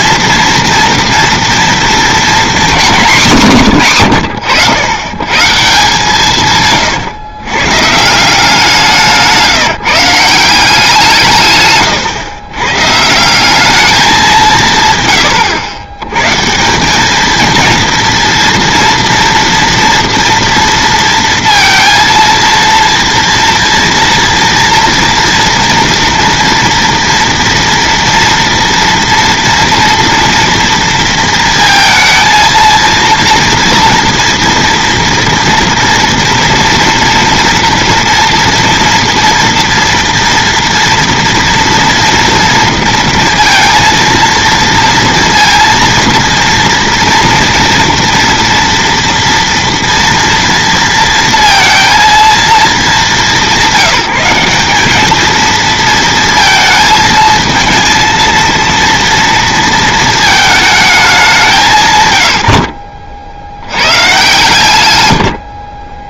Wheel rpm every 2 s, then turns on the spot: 240, 240, 100, 150, 180, 180, 120, 170, 150, 230, 230, 230, 230, 230, 240, 230, 230, 230, 240, 240, 230, 230, 230, 230, 230, 230, 220, 190, 220, 230, 220, 90, 120.
none